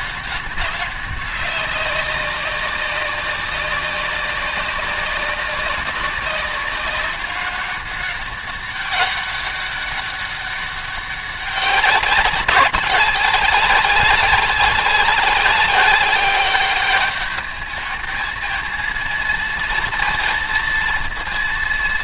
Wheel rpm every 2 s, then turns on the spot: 190, 190, 190, 200, 200, 200, 200, 190, 200, 230, 230.
none